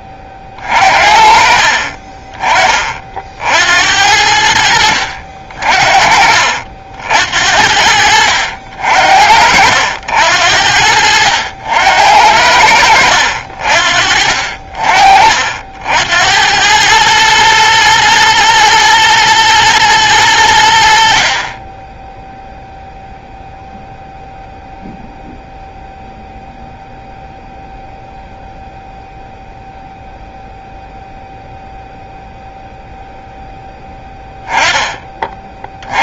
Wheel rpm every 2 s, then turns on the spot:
50, 30, 70, 60, 70, 70, 70, 50, 100, 120, 80, 0, 0, 0, 0, 0, 0, 10.
none